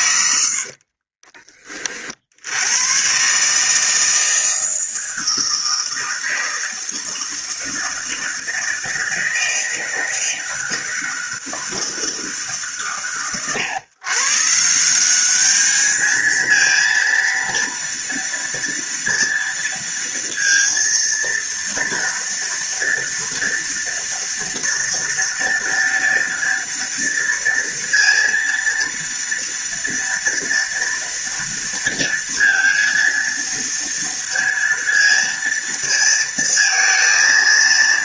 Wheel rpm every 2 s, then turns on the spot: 50, 110, 160, 160, 160, 160, 120, 180, 230, 230, 230, 230, 230, 230, 230, 230, 230, 230, 230.
0-2